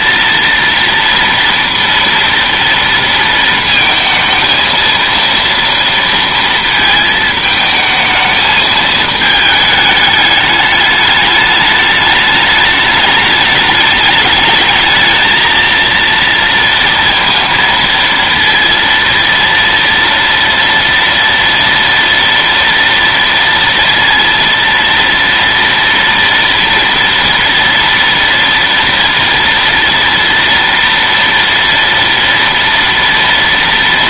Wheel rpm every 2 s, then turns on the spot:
230, 230, 230, 230, 220, 210, 210, 220, 230, 230, 230, 230, 230, 240, 230, 230, 230.
none